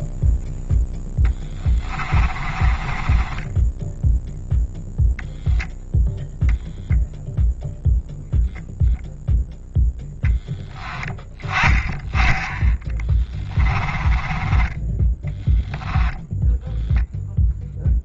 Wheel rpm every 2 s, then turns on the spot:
0, 20, 0, 0, 0, 10, 10, 20, 0.
2-4